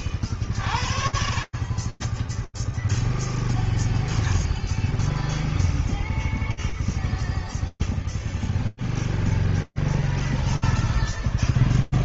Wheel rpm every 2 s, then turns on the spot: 0, 0, 0, 0, 0, 0.
none